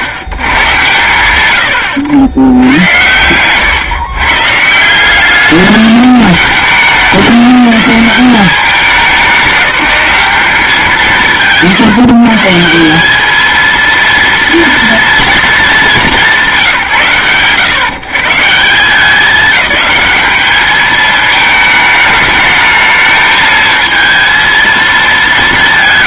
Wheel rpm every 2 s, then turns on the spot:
110, 110, 150, 210, 210, 160, 160, 230, 160, 160, 210, 220, 230.
none